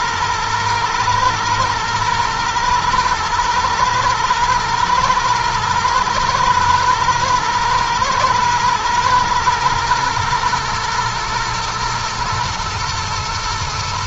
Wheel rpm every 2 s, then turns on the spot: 110, 110, 120, 120, 110, 110, 110.
none